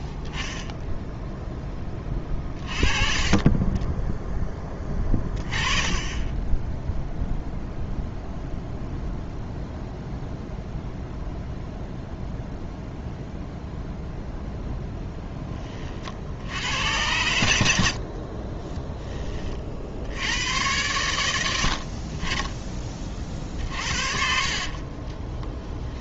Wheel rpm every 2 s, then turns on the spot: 0, 30, 10, 10, 0, 0, 0, 10, 90, 20, 100, 20, 40.
18-20 24-26